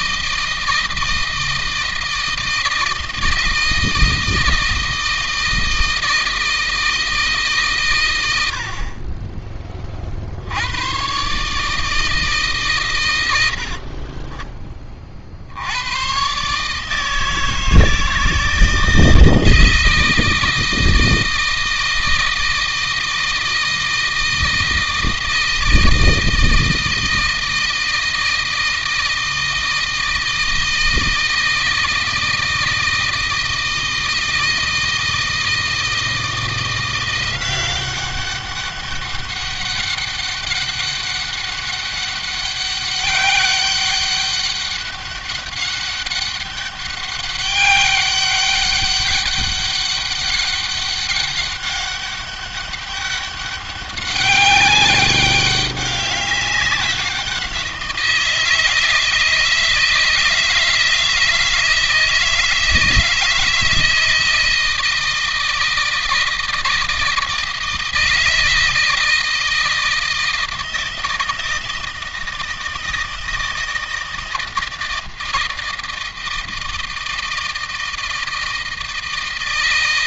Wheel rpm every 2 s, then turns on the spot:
160, 160, 160, 160, 40, 120, 130, 30, 150, 160, 160, 160, 160, 160, 160, 160, 160, 160, 170, 200, 200, 200, 200, 200, 190, 200, 200, 200, 190, 160, 160, 160, 160, 160, 160, 160, 160, 160, 160, 160.
none